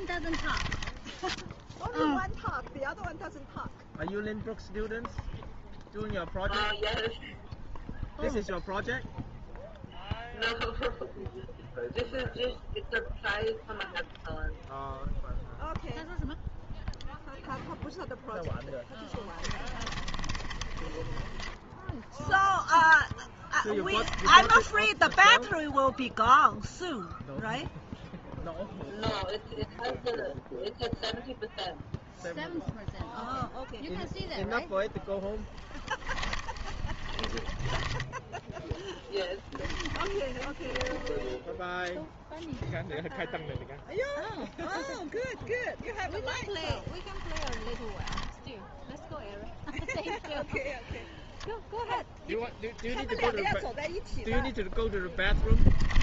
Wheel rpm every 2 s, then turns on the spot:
10, 0, 0, 0, 0, 0, 0, 0, 0, 0, 20, 0, 10, 0, 0, 0, 0, 0, 20, 10, 20, 0, 0, 10, 0, 0, 0, 0.
0-2 20-22 24-26 36-42 46-48